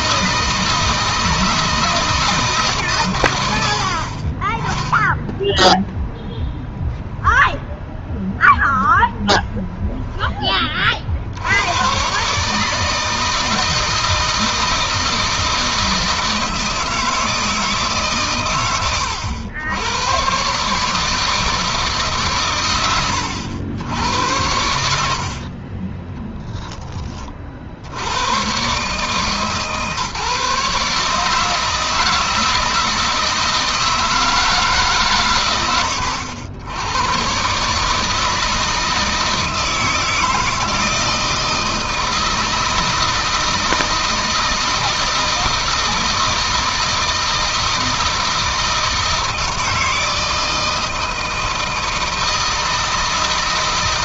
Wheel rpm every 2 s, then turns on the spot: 160, 140, 10, 10, 0, 30, 150, 160, 160, 110, 150, 110, 80, 30, 140, 150, 160, 120, 90, 160, 160, 160, 160, 160, 160, 160, 160.
none